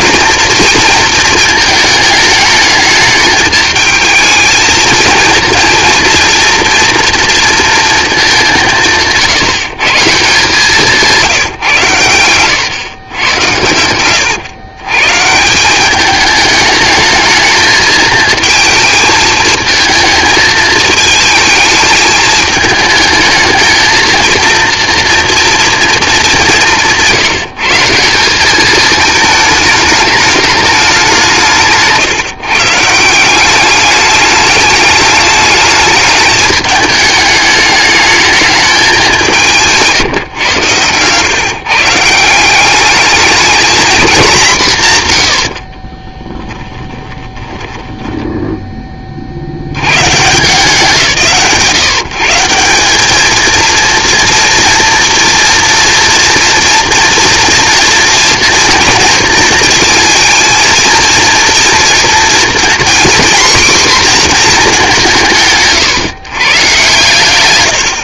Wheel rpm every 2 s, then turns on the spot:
230, 210, 220, 230, 190, 160, 110, 110, 220, 220, 220, 220, 230, 180, 210, 210, 150, 210, 210, 210, 110, 190, 150, 20, 10, 160, 190, 240, 230, 230, 230, 240, 220, 130.
46-48